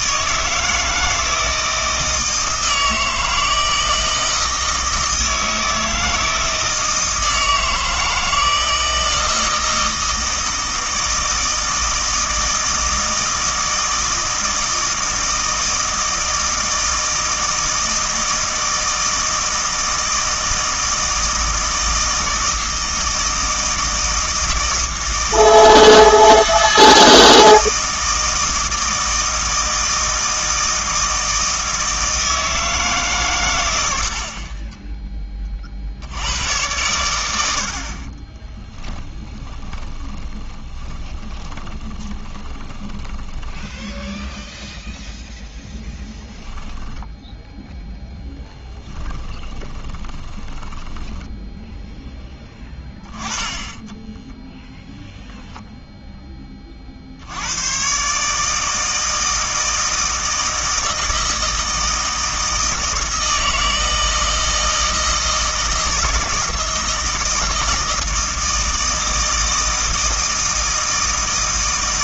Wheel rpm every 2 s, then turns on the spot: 160, 160, 160, 160, 160, 160, 160, 160, 160, 160, 160, 160, 160, 160, 160, 160, 160, 20, 100, 20, 20, 20, 0, 0, 10, 20, 10, 0, 20, 150, 160, 160, 160, 160, 160, 160.
34-36 38-44 48-52